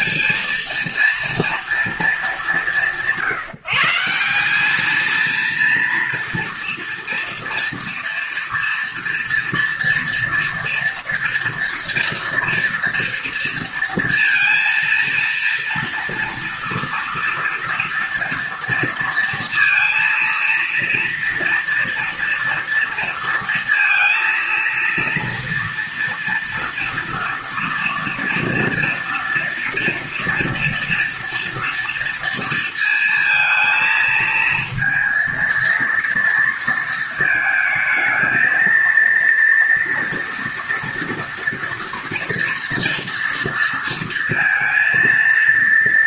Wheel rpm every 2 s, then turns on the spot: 230, 160, 220, 230, 230, 230, 230, 230, 230, 230, 230, 230, 230, 230, 230, 230, 230, 220, 220, 230, 230, 230, 230.
none